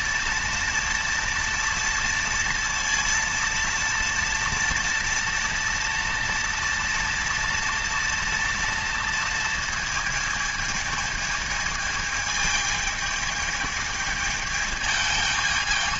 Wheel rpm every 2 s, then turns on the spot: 230, 230, 230, 230, 230, 220, 220, 220.
none